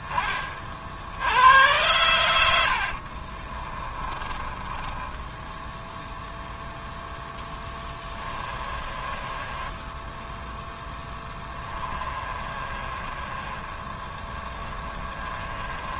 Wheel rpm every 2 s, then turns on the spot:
70, 60, 20, 0, 20, 10, 30, 20.
2-6 8-16